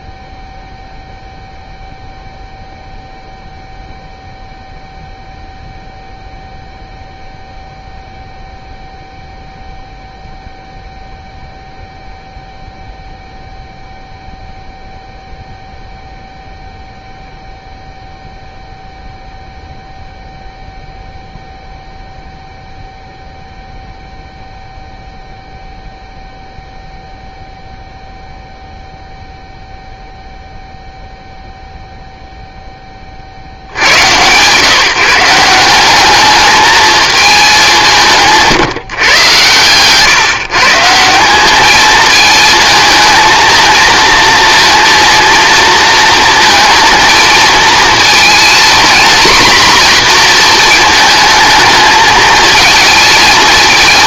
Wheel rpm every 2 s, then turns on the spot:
0, 0, 0, 0, 0, 0, 0, 0, 0, 0, 0, 0, 0, 0, 0, 0, 20, 150, 220, 150, 160, 220, 230, 230, 230, 220, 220.
none